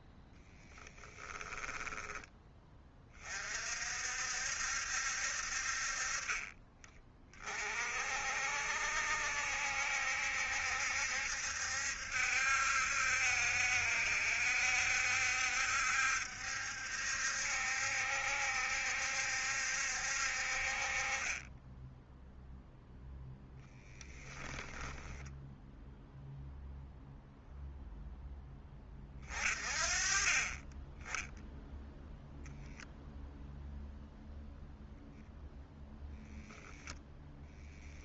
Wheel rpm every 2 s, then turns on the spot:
10, 20, 60, 20, 60, 70, 70, 70, 70, 70, 40, 0, 20, 0, 20, 10, 0, 0, 0.
0-2 24-26